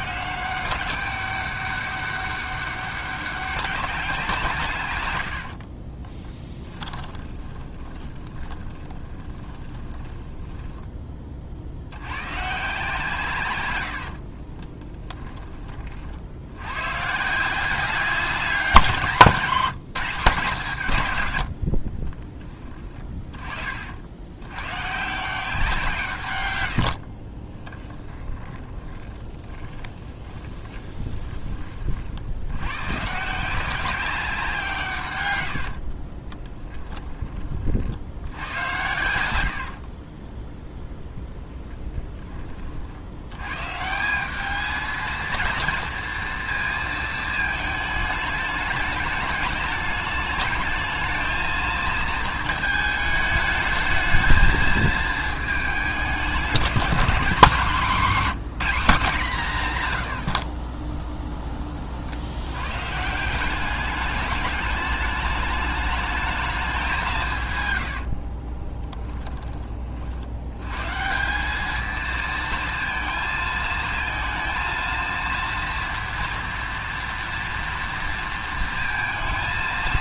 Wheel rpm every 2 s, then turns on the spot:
190, 200, 130, 20, 20, 10, 150, 20, 130, 190, 160, 10, 130, 70, 20, 20, 120, 150, 10, 100, 0, 50, 220, 230, 210, 220, 220, 220, 210, 210, 20, 150, 210, 210, 20, 120, 230, 230, 230, 230.
6-10 14-16 26-32 60-62 68-70